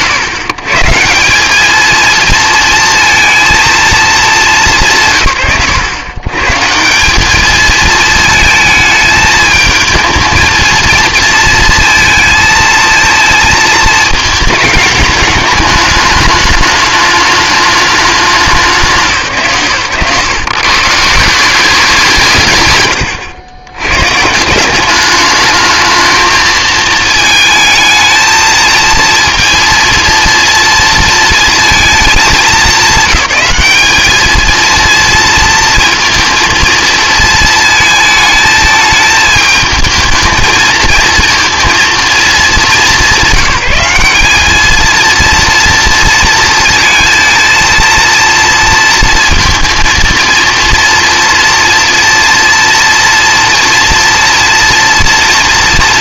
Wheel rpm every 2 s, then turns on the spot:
150, 230, 170, 160, 220, 230, 230, 220, 210, 180, 160, 120, 180, 220, 230, 230, 200, 230, 230, 220, 220, 210, 210, 220, 230, 230, 230, 230.
none